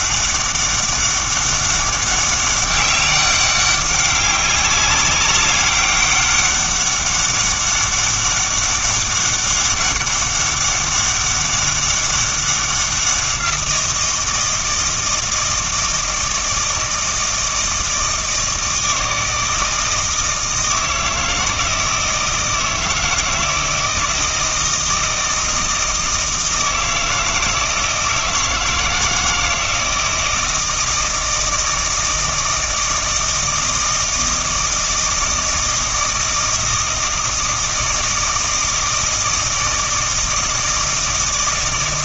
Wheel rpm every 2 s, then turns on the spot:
200, 200, 200, 200, 200, 200, 190, 160, 160, 160, 160, 160, 160, 160, 160, 160, 160, 160, 160, 160, 160.
none